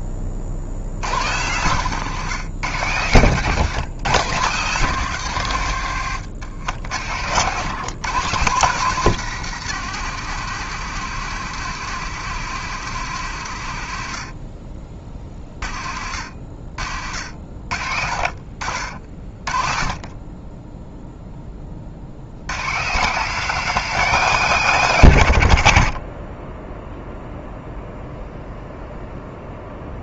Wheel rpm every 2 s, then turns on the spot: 80, 130, 130, 90, 170, 150, 140, 40, 60, 40, 0, 150, 150, 0, 0.
none